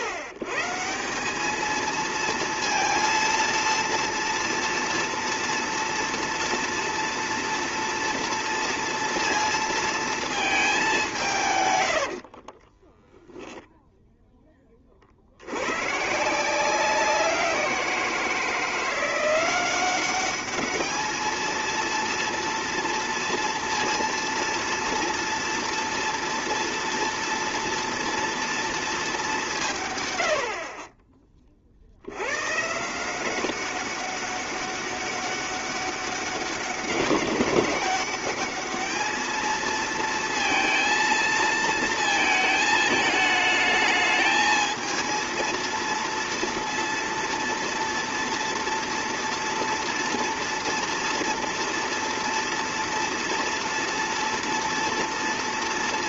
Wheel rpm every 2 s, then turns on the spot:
120, 230, 230, 230, 230, 210, 30, 20, 170, 170, 210, 230, 230, 230, 230, 50, 120, 200, 200, 210, 230, 220, 220, 230, 240, 240, 230, 230.
12-14